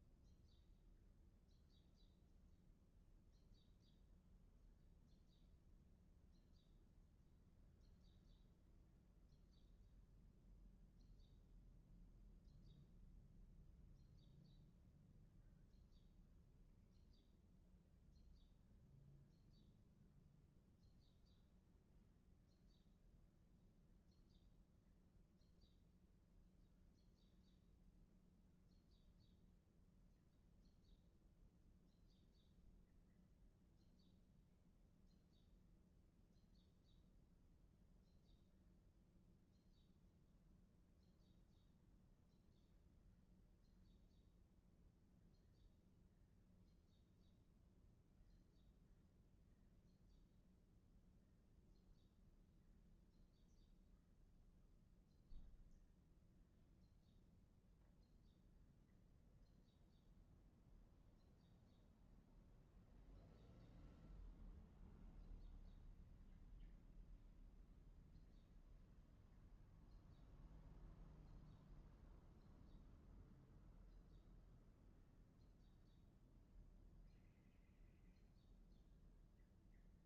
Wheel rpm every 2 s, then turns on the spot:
0, 0, 0, 0, 0, 0, 0, 0, 0, 0, 0, 0, 0, 0, 0, 0, 0, 0, 0, 0, 0, 0, 0, 0, 0, 0, 0, 0, 0, 0, 0, 0, 0, 0, 0, 0, 0, 0, 0, 0.
none